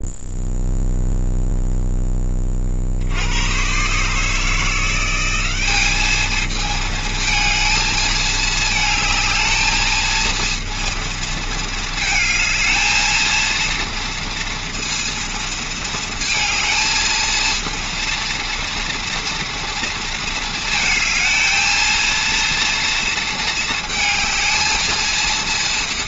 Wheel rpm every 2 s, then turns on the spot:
0, 40, 160, 220, 220, 230, 220, 230, 220, 240, 230, 230, 220.
none